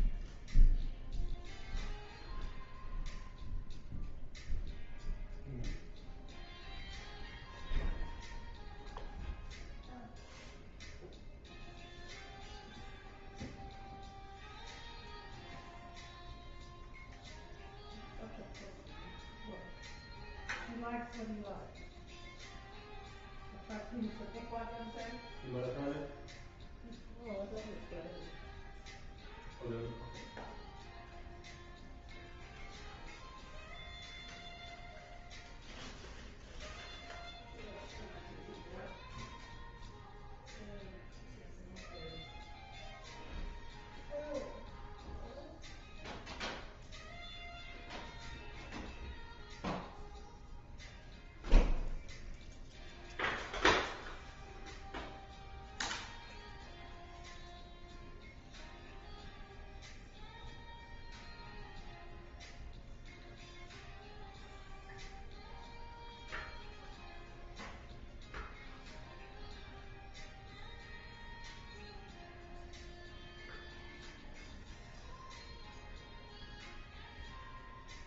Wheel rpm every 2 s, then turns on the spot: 0, 0, 0, 0, 0, 0, 0, 0, 0, 0, 0, 0, 0, 0, 0, 0, 0, 0, 0, 0, 0, 0, 0, 0, 0, 0, 0, 0, 0, 0, 0, 0, 0, 0, 0, 0, 0, 0, 0.
none